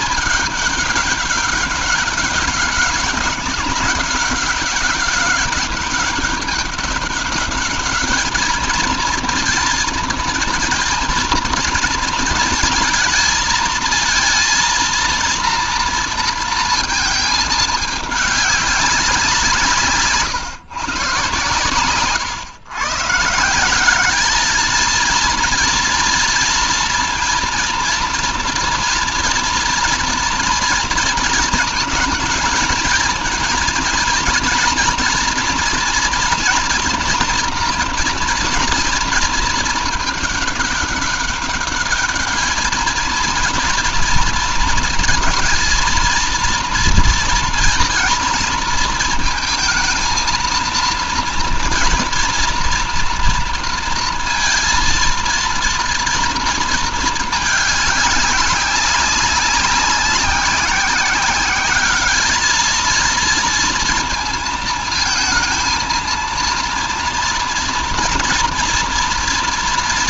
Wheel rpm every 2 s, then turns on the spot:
200, 190, 200, 200, 230, 230, 220, 230, 220, 190, 130, 140, 230, 230, 230, 230, 230, 240, 230, 230, 200, 220, 220, 230, 230, 230, 230, 230, 220, 200, 190, 220, 230, 230, 230.
none